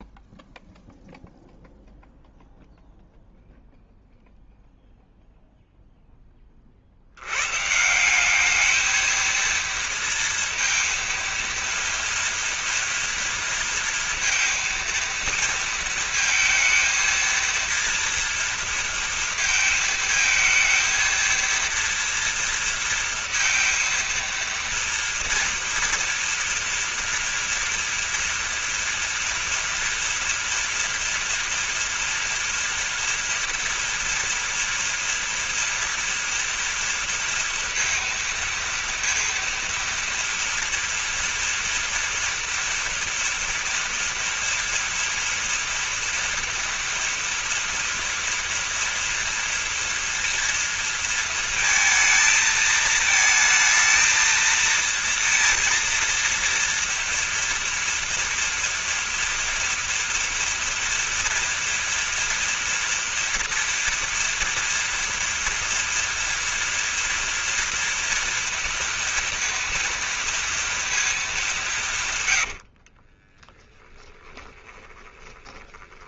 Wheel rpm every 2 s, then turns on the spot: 0, 0, 0, 50, 220, 230, 230, 230, 230, 230, 230, 230, 230, 230, 230, 230, 240, 230, 230, 230, 230, 230, 230, 230, 230, 230, 220, 230, 230, 240, 230, 240, 230, 230, 230, 220, 50, 20.
72-76